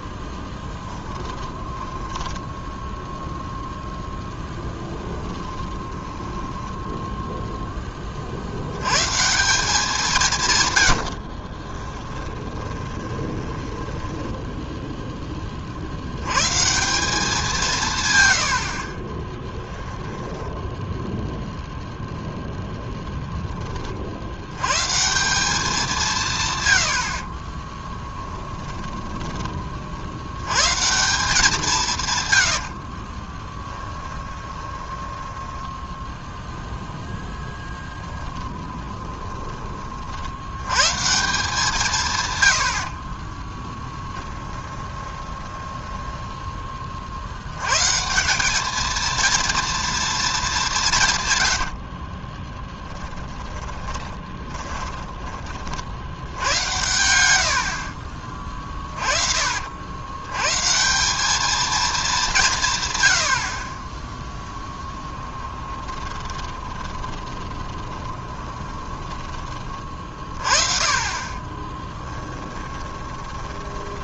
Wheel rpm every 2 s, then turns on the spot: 10, 10, 10, 10, 60, 140, 20, 10, 130, 90, 10, 0, 100, 110, 20, 110, 80, 20, 0, 20, 100, 110, 20, 10, 190, 210, 10, 20, 90, 30, 120, 170, 10, 20, 20, 40, 20.
0-8 12-16 18-22 28-30 32-36 38-40 44-46 52-56 58-60 64-70 72-74